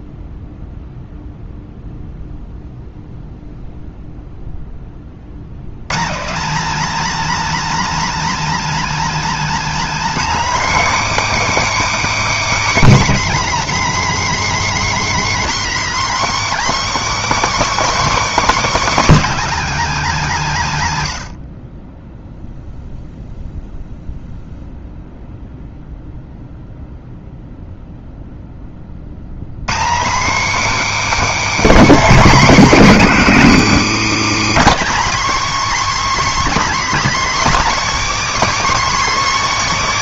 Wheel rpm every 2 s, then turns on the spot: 0, 0, 10, 250, 290, 310, 300, 300, 310, 300, 180, 0, 0, 0, 20, 310, 270, 250, 310, 320.
none